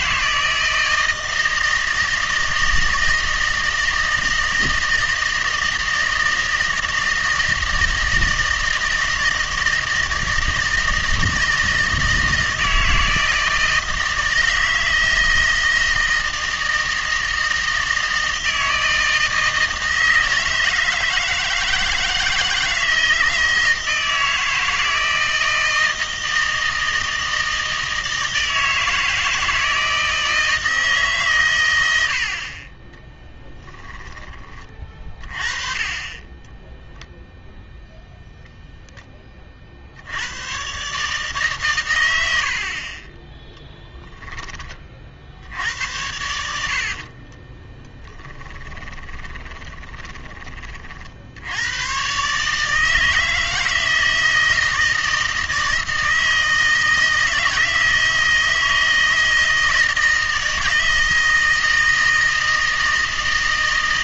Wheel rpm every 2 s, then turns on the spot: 160, 160, 160, 160, 160, 160, 160, 160, 160, 160, 160, 160, 160, 160, 160, 160, 30, 30, 0, 0, 120, 50, 20, 70, 10, 40, 150, 160, 160, 160, 160, 160.
46-50